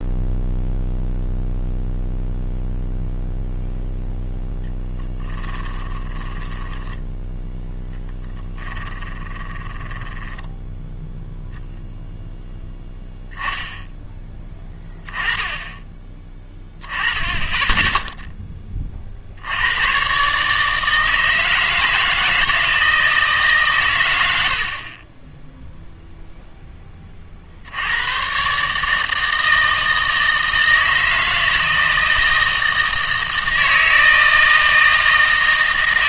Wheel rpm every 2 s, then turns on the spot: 0, 0, 10, 10, 10, 10, 10, 10, 10, 20, 150, 160, 50, 10, 140, 160, 160, 160.
4-10